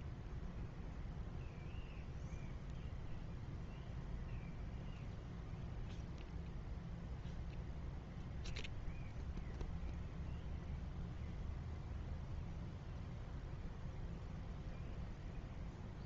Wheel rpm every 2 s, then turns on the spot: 0, 0, 0, 0, 0, 0, 0, 0.
none